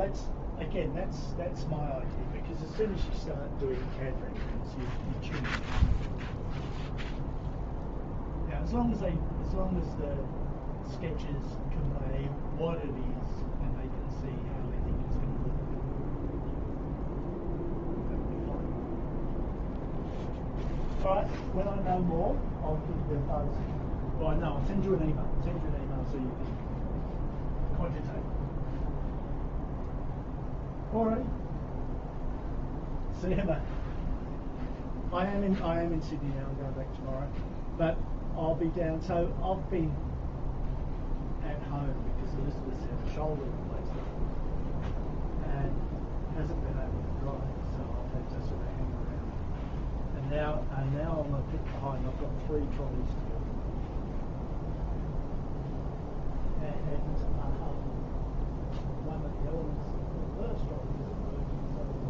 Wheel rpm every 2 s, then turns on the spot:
0, 0, 0, 0, 0, 0, 0, 0, 0, 0, 0, 0, 0, 0, 0, 0, 0, 0, 0, 0, 0, 0, 0, 0, 0, 0, 0, 0, 0, 0, 0.
none